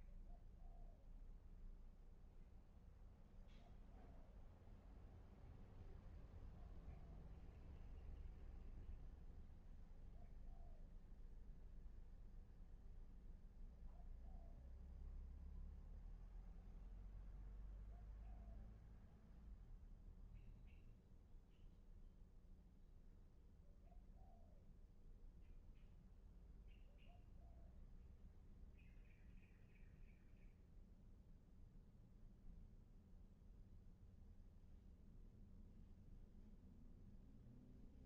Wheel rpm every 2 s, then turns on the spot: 0, 0, 0, 0, 0, 0, 0, 0, 0, 0, 0, 0, 0, 0, 0, 0, 0, 0, 0.
none